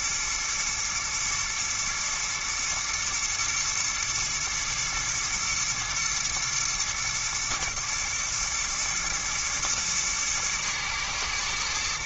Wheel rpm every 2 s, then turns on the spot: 120, 120, 110, 120, 110, 110.
none